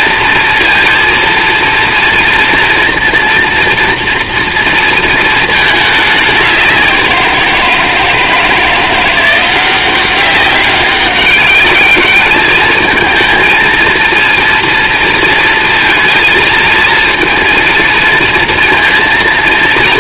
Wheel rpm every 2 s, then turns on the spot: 230, 230, 230, 180, 170, 190, 220, 230, 220, 230.
none